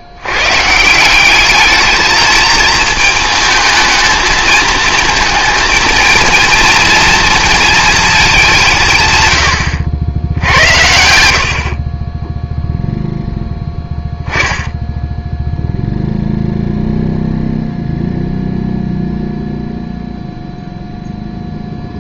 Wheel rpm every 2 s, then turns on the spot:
140, 220, 220, 230, 180, 80, 0, 10, 0, 0, 0.
10-12